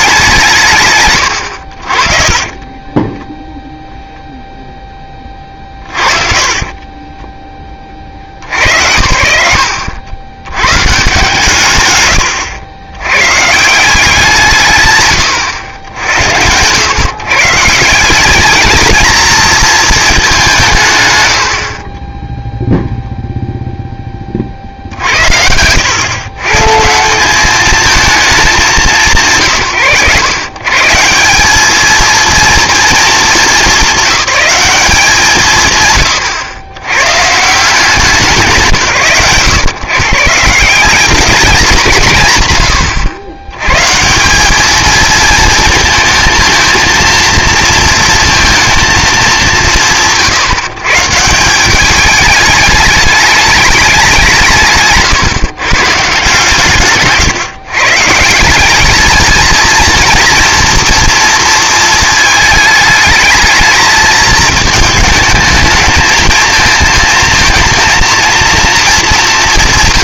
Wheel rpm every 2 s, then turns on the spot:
50, 0, 40, 20, 80, 130, 170, 100, 150, 220, 70, 0, 80, 200, 140, 180, 210, 160, 130, 110, 210, 100, 220, 230, 200, 160, 210, 140, 140, 220, 230, 220, 220, 230, 190.
4-6 8-10 20-22